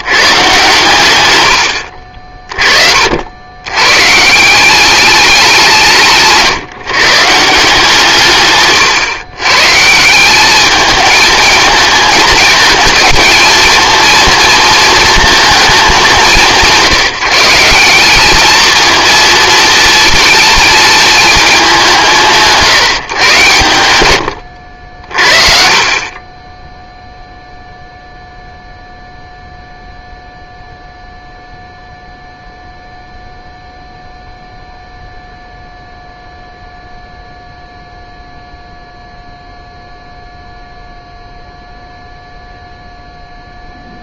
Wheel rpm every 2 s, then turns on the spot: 130, 40, 180, 150, 140, 200, 210, 230, 170, 220, 220, 150, 60, 10, 0, 0, 0, 0, 0, 0, 0, 0.
none